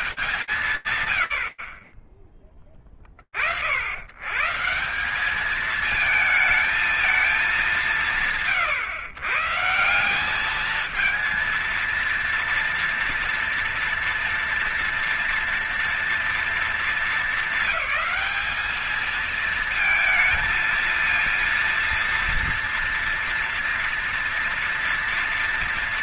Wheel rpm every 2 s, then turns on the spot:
130, 60, 190, 210, 150, 230, 230, 230, 220, 220, 230, 230, 230.
none